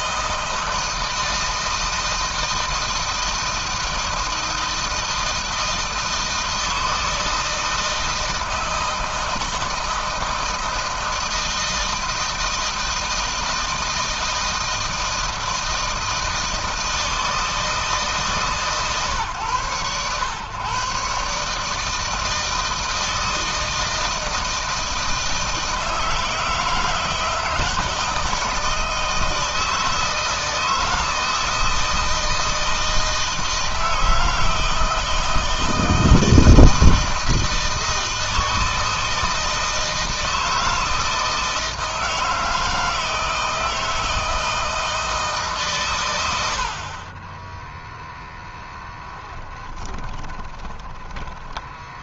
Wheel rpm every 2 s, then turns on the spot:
160, 160, 160, 160, 160, 160, 160, 160, 160, 130, 140, 160, 160, 160, 160, 160, 160, 160, 160, 160, 160, 160, 150, 20, 10, 40.
46-50